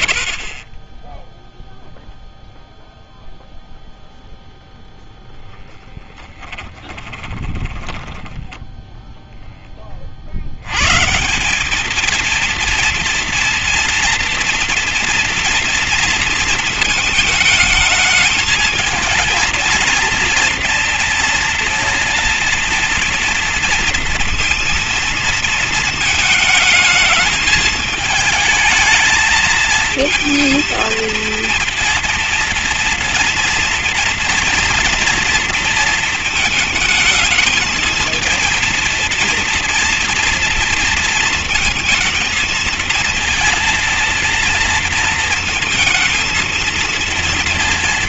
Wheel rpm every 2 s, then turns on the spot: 20, 0, 0, 20, 10, 130, 230, 230, 220, 220, 230, 230, 230, 220, 220, 240, 230, 230, 220, 230, 230, 230, 230, 230.
0-2 6-8